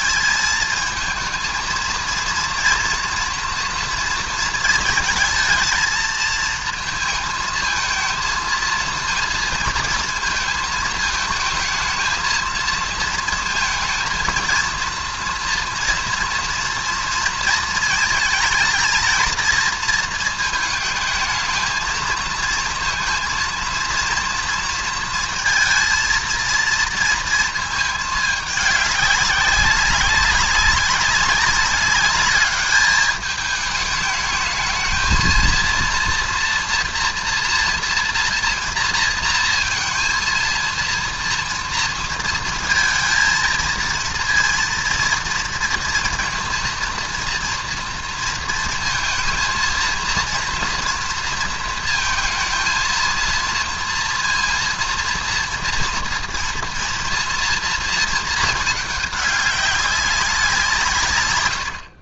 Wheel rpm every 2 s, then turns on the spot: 190, 230, 230, 220, 230, 230, 230, 230, 230, 220, 230, 230, 230, 230, 210, 200, 210, 210, 230, 230, 230, 230, 230, 230, 230, 230, 220, 230, 230, 220, 190.
none